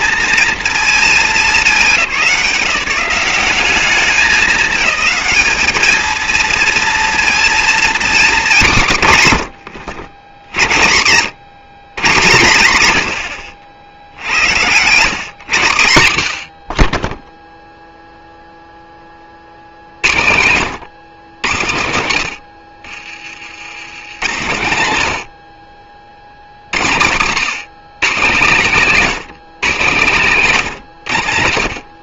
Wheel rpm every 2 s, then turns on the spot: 220, 180, 210, 230, 200, 40, 100, 90, 50, 0, 100, 60, 100, 90, 160, 150.
none